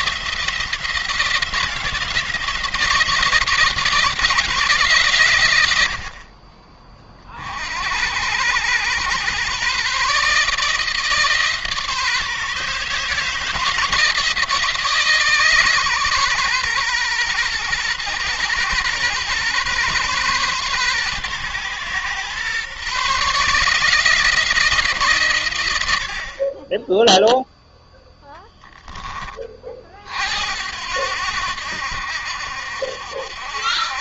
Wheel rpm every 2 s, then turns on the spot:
170, 170, 140, 40, 110, 150, 150, 160, 130, 120, 130, 130, 160, 30, 10, 80, 70.
none